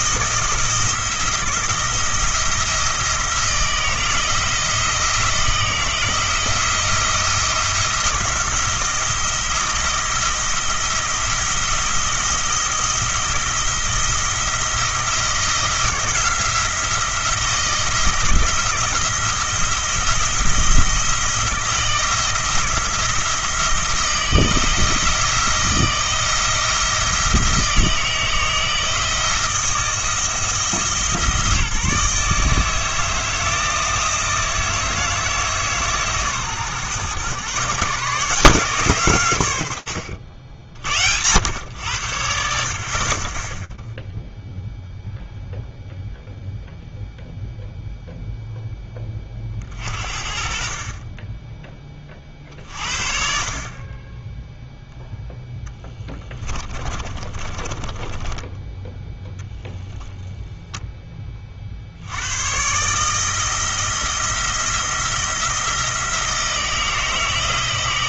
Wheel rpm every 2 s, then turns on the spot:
150, 170, 170, 170, 170, 170, 170, 170, 170, 170, 170, 170, 170, 170, 160, 160, 160, 160, 130, 160, 70, 60, 0, 0, 10, 30, 40, 0, 20, 10, 0, 130, 170, 160.
56-60